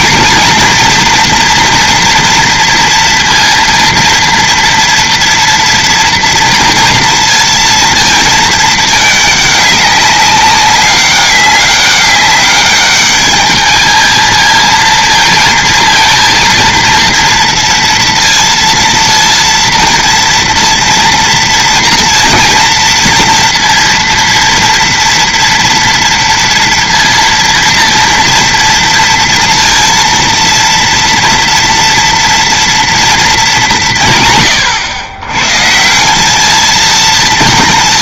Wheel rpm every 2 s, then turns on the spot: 230, 230, 230, 230, 220, 200, 200, 220, 230, 230, 230, 230, 230, 230, 230, 230, 230, 130, 220.
none